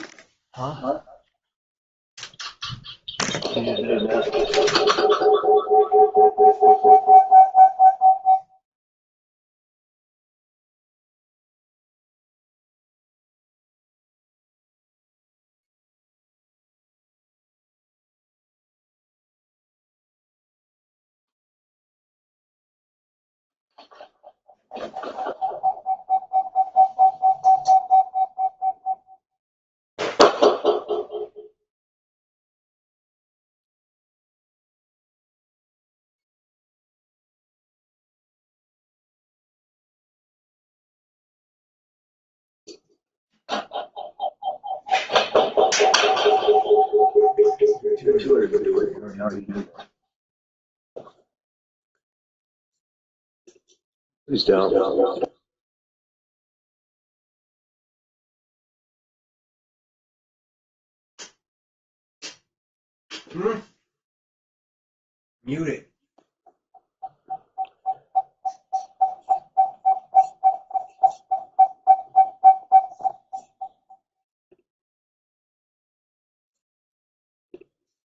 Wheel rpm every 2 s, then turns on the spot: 0, 0, 0, 0, 0, 0, 0, 0, 0, 0, 0, 0, 0, 0, 0, 0, 0, 0, 0, 0, 0, 0, 0, 0, 0, 0, 0, 0, 0, 0, 0, 0, 0, 0, 0, 0, 0, 0, 0.
none